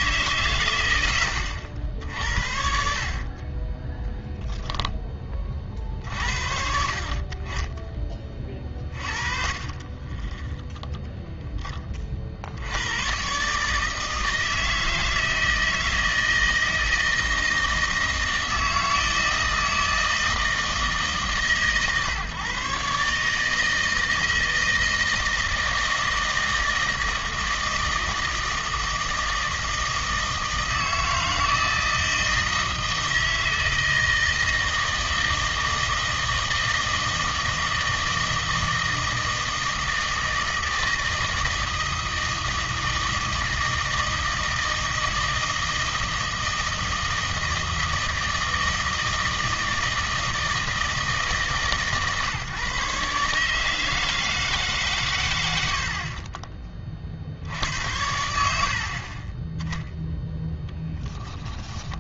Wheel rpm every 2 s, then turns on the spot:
110, 60, 0, 80, 40, 20, 70, 160, 160, 160, 160, 140, 160, 160, 160, 160, 160, 160, 160, 160, 160, 160, 160, 160, 160, 160, 140, 150, 30, 50, 0.
10-12